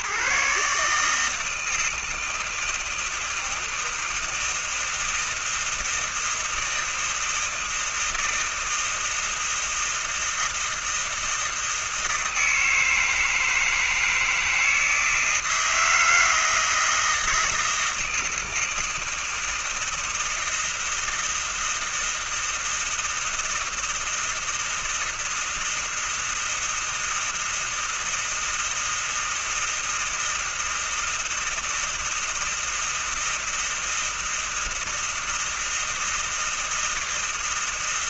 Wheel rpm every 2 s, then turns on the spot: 150, 160, 160, 160, 160, 160, 160, 160, 160, 160, 160, 160, 160, 160, 160, 160, 160, 160, 160.
none